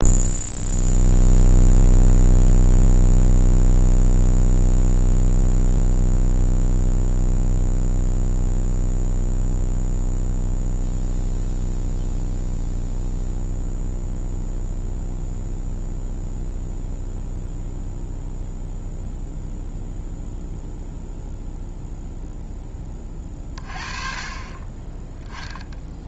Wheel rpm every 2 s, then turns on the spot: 0, 0, 0, 0, 0, 0, 0, 0, 0, 0, 0, 10, 30.
none